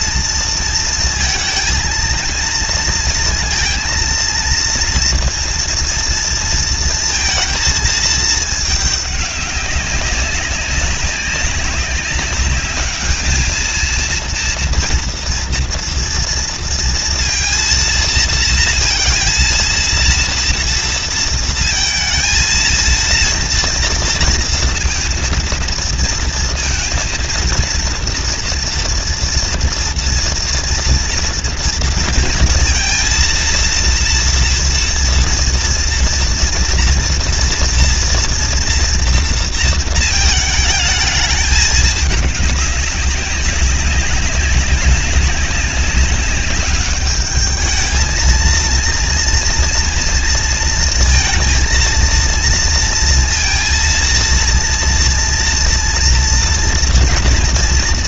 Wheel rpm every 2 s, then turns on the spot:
230, 230, 230, 230, 210, 200, 200, 230, 230, 230, 230, 230, 230, 230, 230, 230, 230, 230, 230, 230, 220, 200, 200, 200, 220, 230, 230, 230, 240.
none